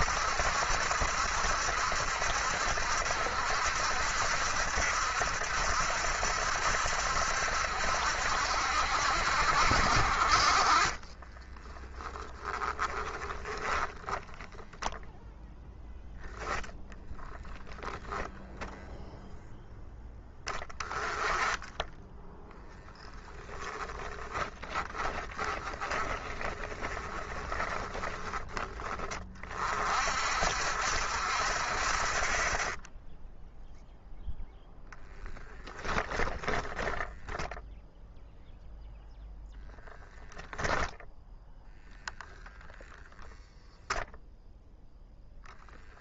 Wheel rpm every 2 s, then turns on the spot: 70, 70, 70, 70, 60, 30, 10, 0, 20, 10, 30, 10, 10, 20, 20, 60, 30, 0, 10, 0, 0, 0, 0.
10-14 16-18 22-28 32-34 36-38